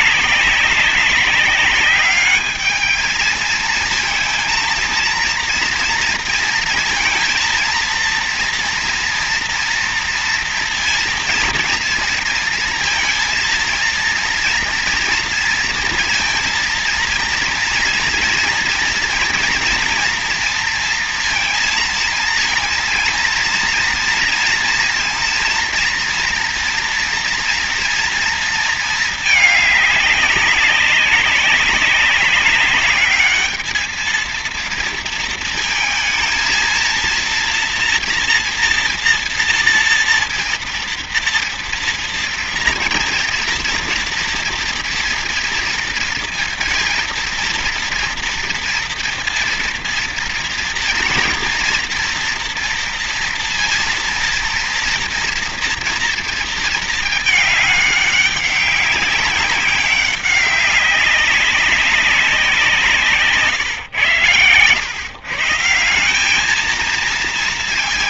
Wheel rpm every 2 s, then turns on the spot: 200, 210, 220, 230, 230, 230, 230, 230, 230, 230, 230, 230, 230, 230, 230, 190, 200, 230, 230, 240, 230, 240, 240, 230, 230, 230, 230, 230, 230, 200, 200, 180, 120, 210.
none